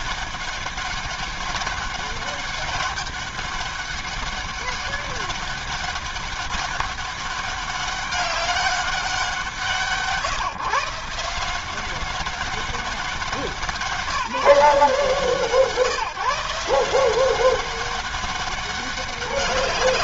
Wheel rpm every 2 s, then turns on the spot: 200, 200, 200, 200, 200, 160, 190, 170, 150, 200.
none